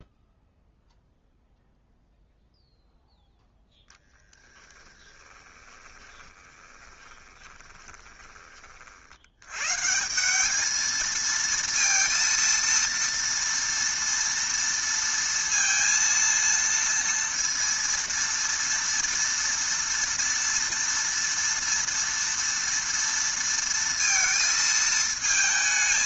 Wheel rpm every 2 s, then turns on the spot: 0, 0, 10, 20, 40, 210, 230, 230, 230, 230, 230, 230, 220.
4-8